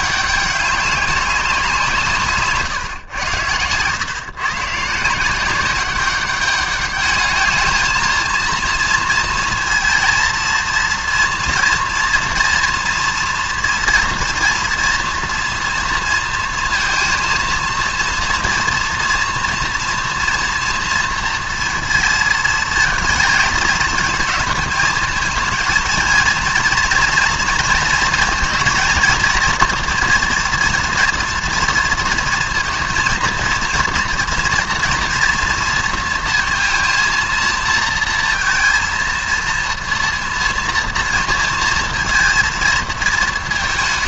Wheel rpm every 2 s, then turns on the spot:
200, 130, 150, 210, 230, 230, 240, 230, 230, 240, 230, 220, 220, 230, 230, 230, 230, 230, 230, 230, 230, 230.
none